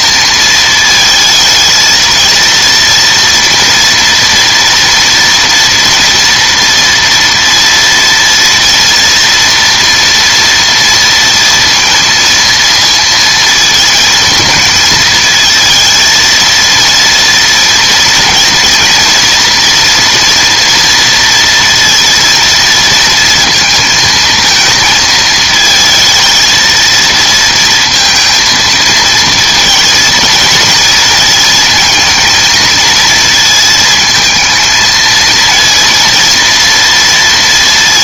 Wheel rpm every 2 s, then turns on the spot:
230, 230, 240, 230, 230, 230, 230, 220, 230, 230, 230, 230, 230, 230, 220, 230, 230, 230, 230.
none